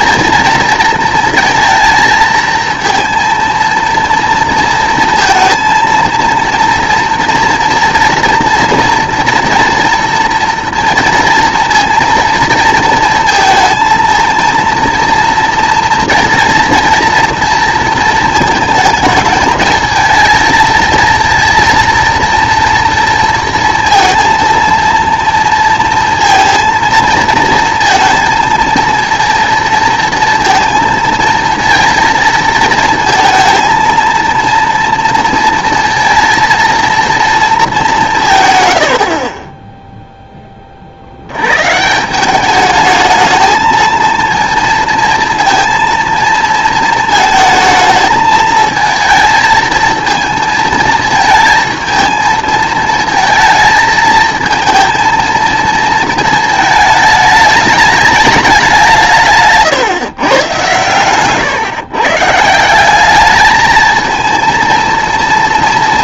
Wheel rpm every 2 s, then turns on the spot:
230, 230, 230, 230, 230, 230, 230, 230, 230, 220, 220, 230, 230, 230, 230, 230, 230, 230, 230, 110, 30, 210, 230, 230, 220, 230, 220, 220, 220, 190, 120, 180, 230.
none